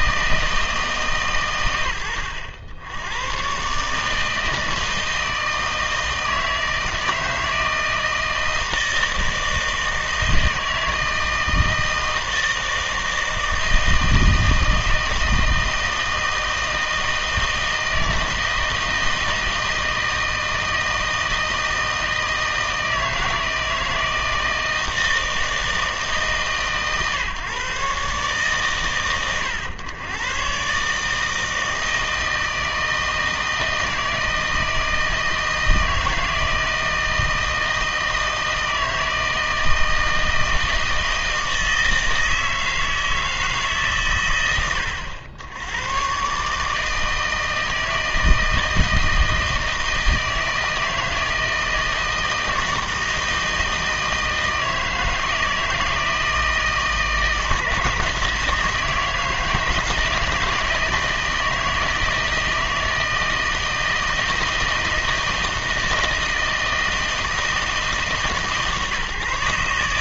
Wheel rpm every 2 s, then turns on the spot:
160, 80, 160, 160, 160, 160, 160, 160, 160, 160, 160, 160, 160, 140, 140, 140, 160, 160, 160, 160, 160, 160, 110, 150, 160, 160, 160, 160, 160, 160, 160, 160, 160, 160, 150.
none